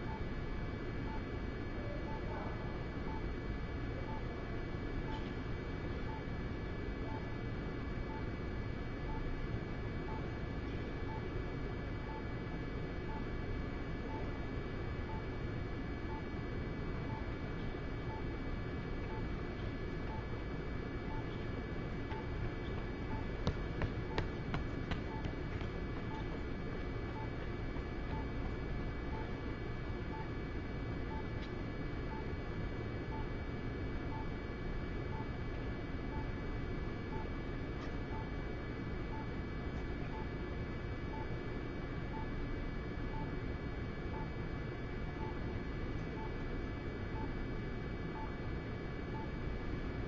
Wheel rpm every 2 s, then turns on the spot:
0, 0, 0, 0, 0, 0, 0, 0, 0, 0, 0, 0, 0, 0, 0, 0, 0, 0, 0, 0, 0, 0, 0, 0, 0.
none